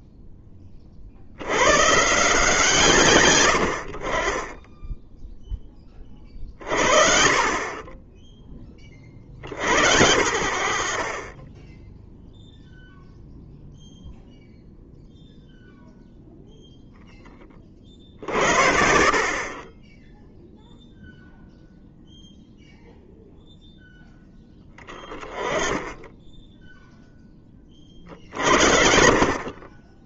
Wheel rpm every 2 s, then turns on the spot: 30, 160, 10, 40, 40, 40, 0, 0, 0, 50, 0, 0, 10, 0, 50.
none